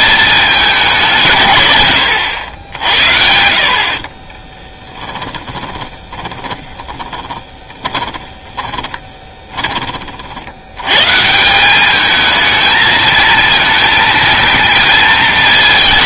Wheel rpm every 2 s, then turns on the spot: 190, 80, 20, 10, 20, 100, 220, 230.
4-10